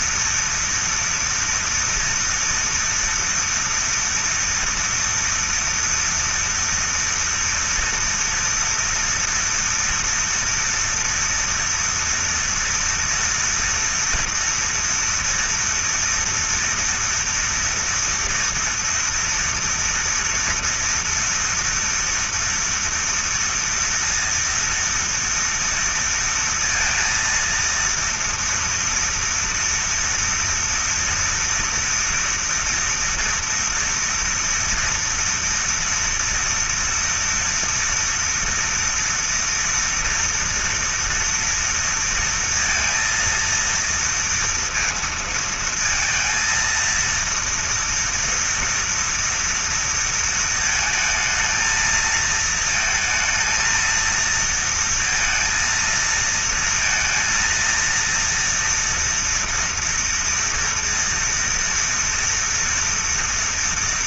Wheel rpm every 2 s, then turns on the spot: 230, 230, 230, 230, 230, 230, 230, 230, 230, 230, 230, 230, 230, 230, 230, 230, 230, 230, 230, 230, 230, 230, 230, 230, 240, 220, 220, 230, 230, 240, 230, 230.
none